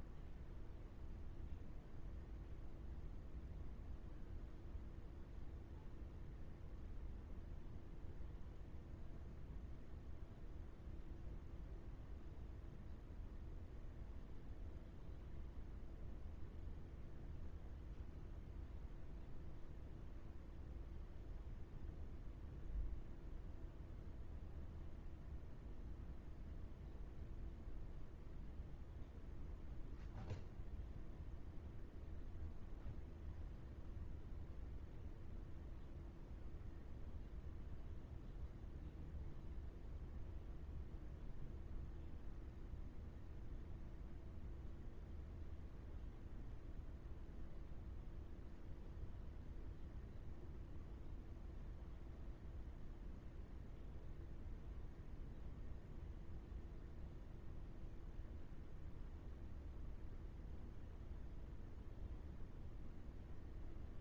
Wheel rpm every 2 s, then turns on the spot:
0, 0, 0, 0, 0, 0, 0, 0, 0, 0, 0, 0, 0, 0, 0, 0, 0, 0, 0, 0, 0, 0, 0, 0, 0, 0, 0, 0, 0, 0, 0, 0.
none